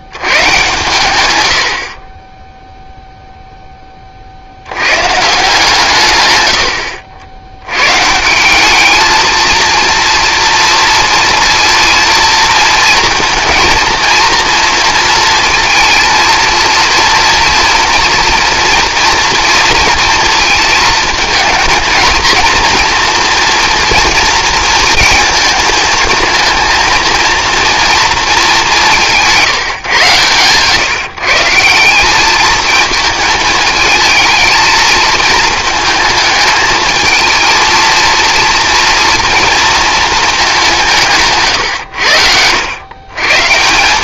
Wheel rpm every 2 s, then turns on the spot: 130, 0, 120, 80, 220, 230, 220, 230, 230, 240, 220, 240, 230, 230, 170, 150, 220, 220, 220, 230, 160, 110.
none